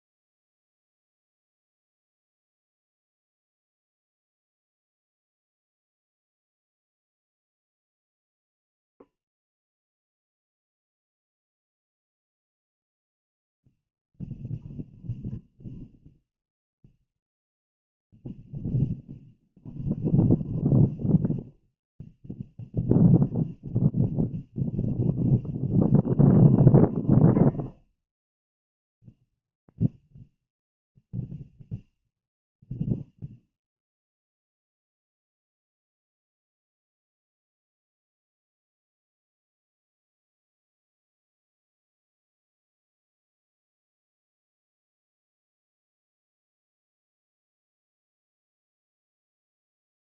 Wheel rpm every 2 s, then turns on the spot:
0, 0, 0, 0, 0, 0, 0, 0, 0, 0, 0, 0, 0, 0, 0, 0, 0, 0, 0, 0, 0, 0, 0, 0, 0.
none